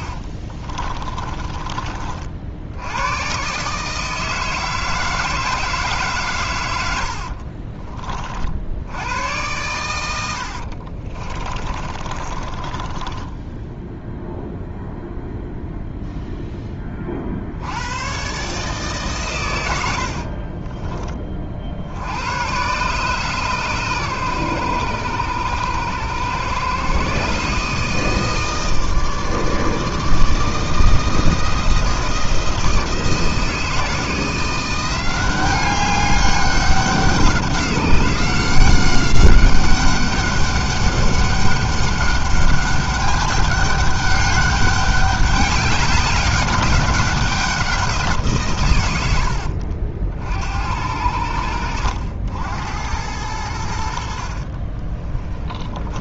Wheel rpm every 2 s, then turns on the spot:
30, 100, 160, 80, 90, 50, 30, 0, 30, 140, 30, 130, 100, 130, 160, 160, 160, 180, 190, 190, 200, 200, 200, 190, 100, 80, 90, 20.
0-2 6-8 10-14 54-56